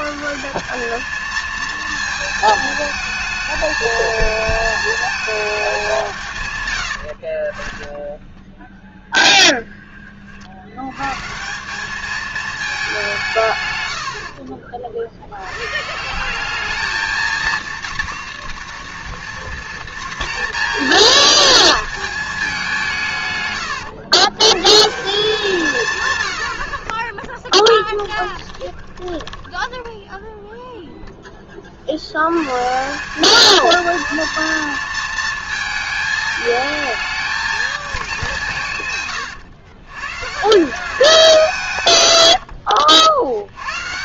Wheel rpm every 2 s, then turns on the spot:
170, 220, 220, 120, 10, 70, 210, 50, 190, 240, 230, 190, 140, 40, 10, 0, 150, 230, 220, 170, 160, 80.
8-10 14-16 28-30 42-44